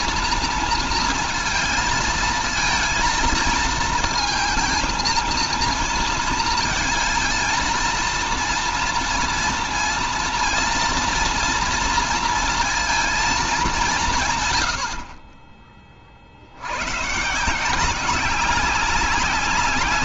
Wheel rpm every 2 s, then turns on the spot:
230, 230, 230, 230, 230, 230, 230, 100, 100, 190.
none